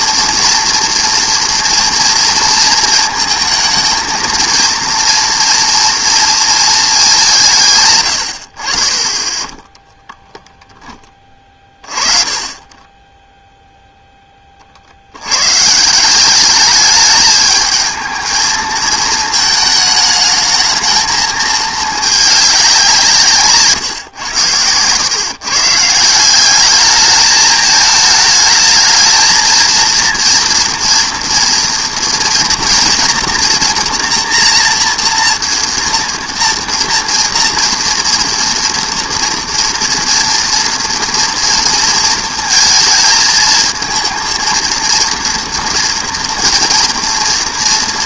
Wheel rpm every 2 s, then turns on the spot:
230, 230, 230, 230, 70, 10, 20, 40, 200, 220, 220, 190, 100, 190, 220, 230, 240, 230, 230, 230, 230, 220, 230, 230.
none